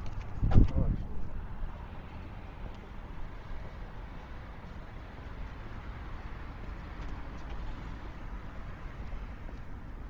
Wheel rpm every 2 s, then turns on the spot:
0, 0, 0, 0, 0.
none